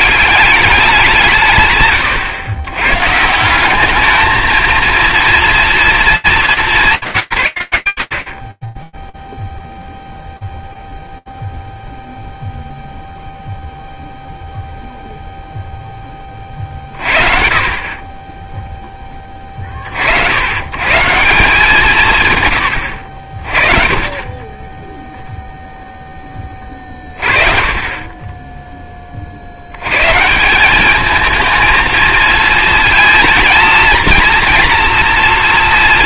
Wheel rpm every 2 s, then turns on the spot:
190, 120, 230, 190, 20, 0, 0, 0, 50, 20, 150, 60, 0, 40, 70, 230, 220, 230.
none